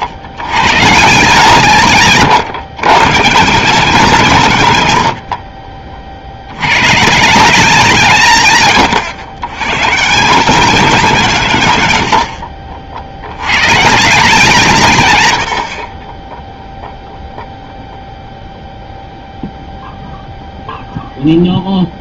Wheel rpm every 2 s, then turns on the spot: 110, 150, 150, 100, 140, 210, 70, 160, 0, 0, 0.
none